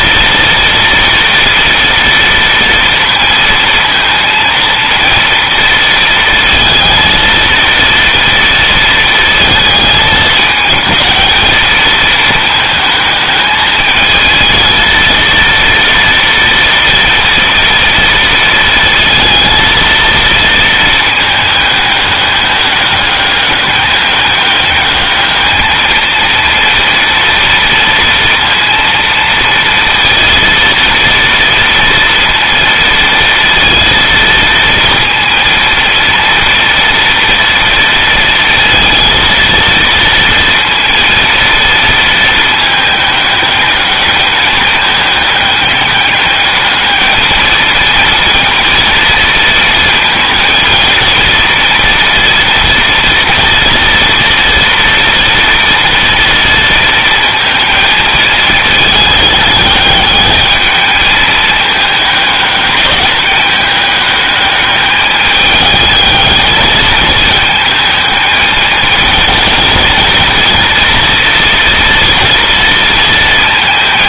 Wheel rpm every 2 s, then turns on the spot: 230, 230, 230, 230, 230, 210, 220, 230, 230, 230, 220, 210, 210, 230, 230, 230, 230, 230, 230, 230, 230, 210, 210, 210, 230, 230, 230, 230, 230, 220, 220, 210, 210, 220, 220, 240, 230.
none